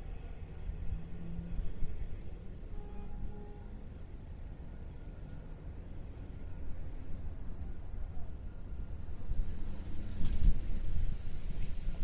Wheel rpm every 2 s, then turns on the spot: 0, 0, 0, 0, 0, 0.
none